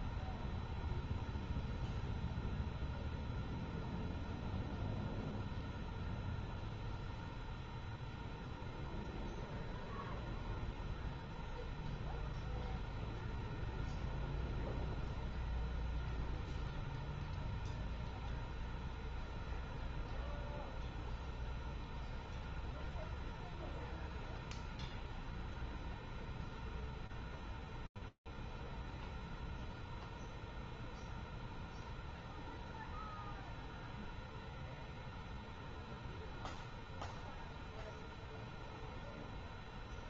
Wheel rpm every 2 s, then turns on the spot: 0, 0, 0, 0, 0, 0, 0, 0, 0, 0, 0, 0, 0, 0, 0, 0, 0, 0, 0, 0.
none